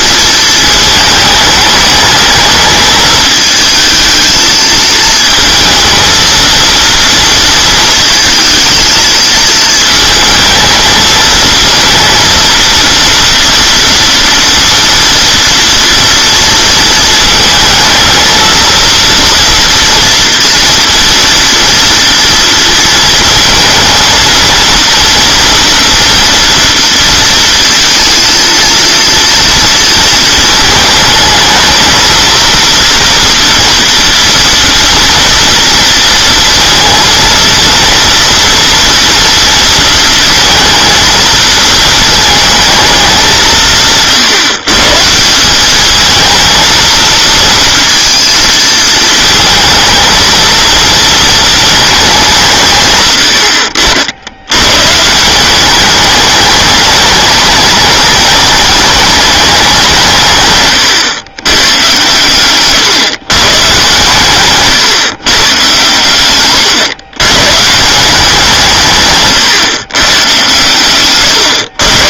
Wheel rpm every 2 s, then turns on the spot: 220, 220, 220, 230, 220, 220, 230, 230, 230, 230, 230, 230, 230, 230, 230, 220, 230, 230, 230, 230, 230, 210, 150, 230, 220, 220, 140, 110, 210, 210, 130, 140, 140, 120, 150, 120.
62-64